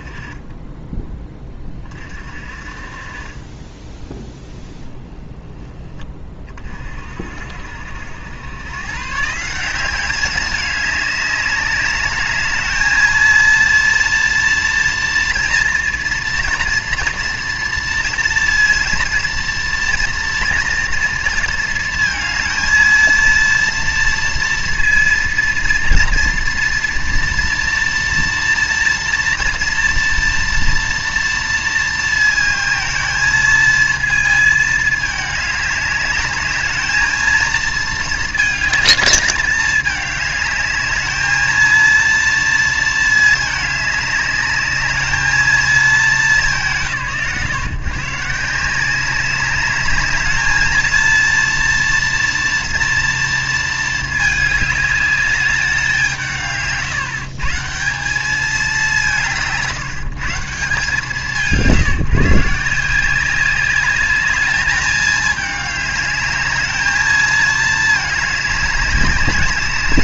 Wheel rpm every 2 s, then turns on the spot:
10, 40, 10, 40, 110, 200, 220, 240, 240, 230, 230, 230, 230, 230, 230, 230, 220, 220, 220, 220, 210, 230, 210, 150, 180, 220, 230, 210, 150, 200, 160, 160, 210, 210, 200.
none